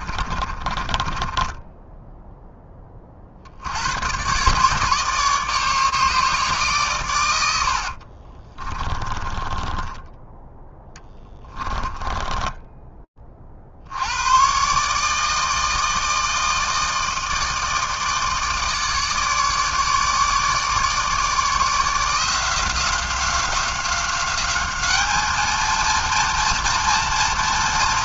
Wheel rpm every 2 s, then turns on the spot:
30, 0, 130, 150, 30, 10, 10, 130, 160, 150, 150, 170, 200, 230.
0-2 8-14